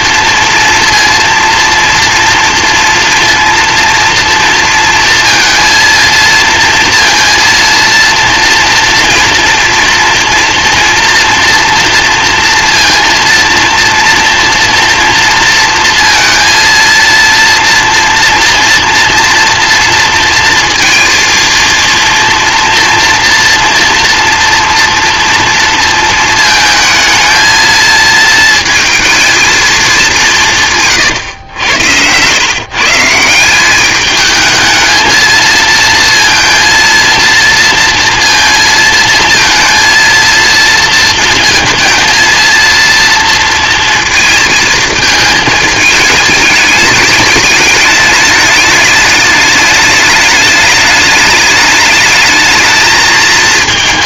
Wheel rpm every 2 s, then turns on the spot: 230, 230, 240, 230, 230, 240, 240, 240, 230, 240, 230, 230, 230, 220, 230, 160, 120, 220, 230, 230, 230, 230, 220, 210, 210, 210, 220.
none